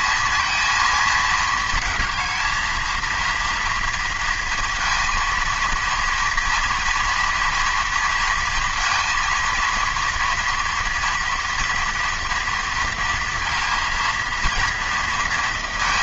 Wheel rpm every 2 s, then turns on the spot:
230, 220, 230, 230, 230, 240, 230, 230.
none